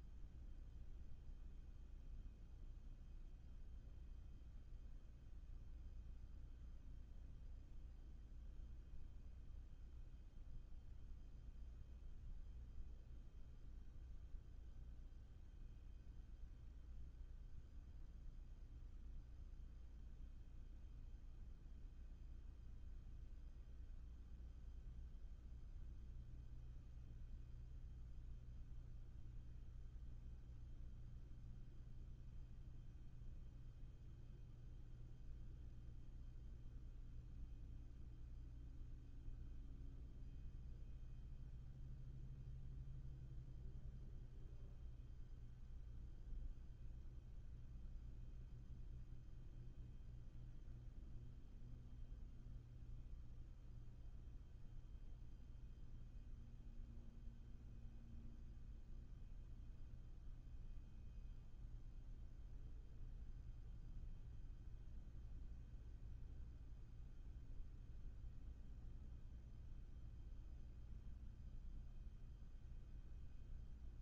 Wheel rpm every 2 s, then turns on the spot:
0, 0, 0, 0, 0, 0, 0, 0, 0, 0, 0, 0, 0, 0, 0, 0, 0, 0, 0, 0, 0, 0, 0, 0, 0, 0, 0, 0, 0, 0, 0, 0, 0, 0, 0, 0, 0.
none